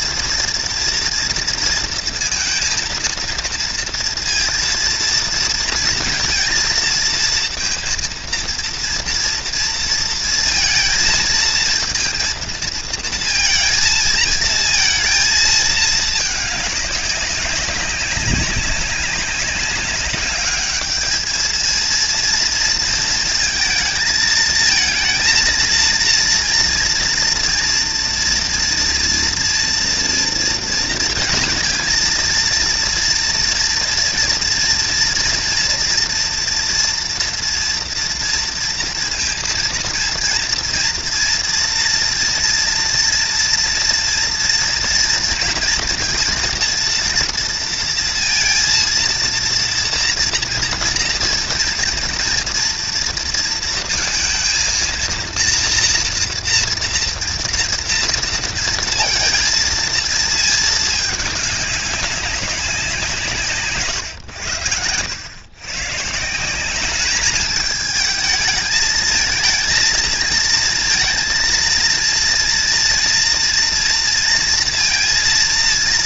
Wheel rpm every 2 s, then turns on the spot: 230, 230, 230, 230, 230, 230, 230, 220, 200, 190, 220, 230, 230, 230, 230, 230, 230, 230, 230, 230, 240, 230, 230, 230, 230, 230, 230, 230, 230, 230, 210, 180, 90, 200, 220, 230, 230, 230.
none